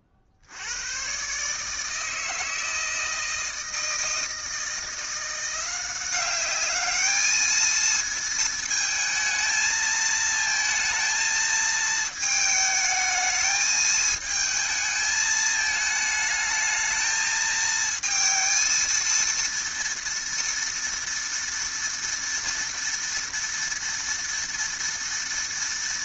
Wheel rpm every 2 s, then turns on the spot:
70, 160, 160, 200, 220, 220, 220, 220, 220, 230, 230, 230, 230.
none